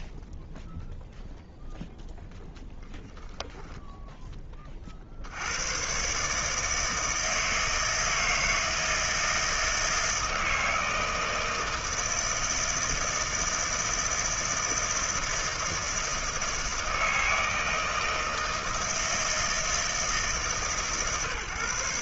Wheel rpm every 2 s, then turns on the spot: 0, 0, 20, 150, 160, 160, 160, 160, 160, 160, 130.
none